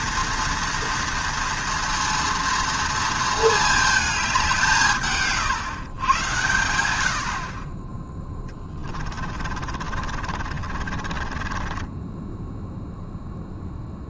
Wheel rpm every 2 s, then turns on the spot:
230, 230, 180, 110, 20, 40, 0.
8-12